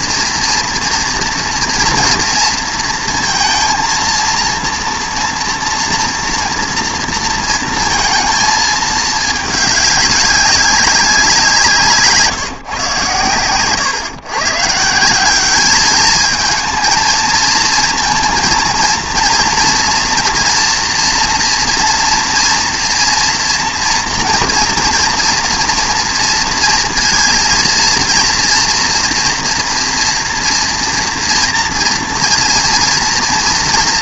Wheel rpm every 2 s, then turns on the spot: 230, 230, 230, 230, 220, 190, 140, 150, 220, 230, 230, 230, 230, 230, 230, 230, 230.
none